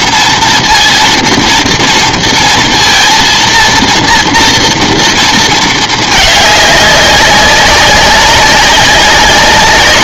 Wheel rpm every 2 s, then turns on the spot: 230, 230, 230, 200, 200.
none